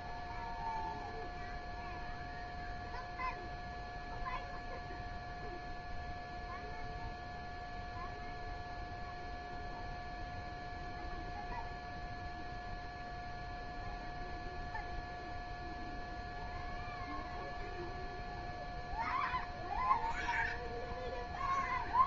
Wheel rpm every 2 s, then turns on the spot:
0, 0, 0, 0, 0, 0, 0, 0, 0, 0, 0.
none